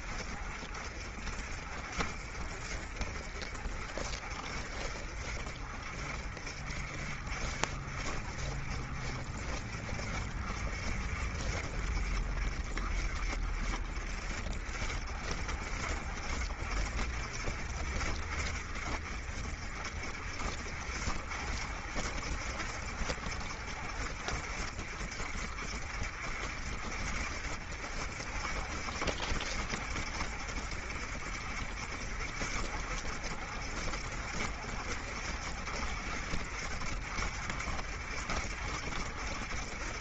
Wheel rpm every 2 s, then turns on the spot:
40, 40, 50, 50, 40, 40, 50, 50, 60, 50, 60, 60, 50, 50, 60, 60, 60, 60, 50, 60.
none